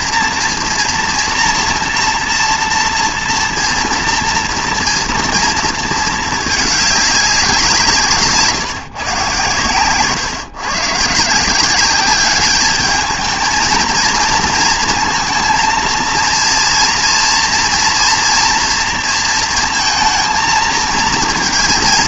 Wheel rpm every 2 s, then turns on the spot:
230, 240, 230, 210, 160, 130, 210, 230, 230, 230, 220.
none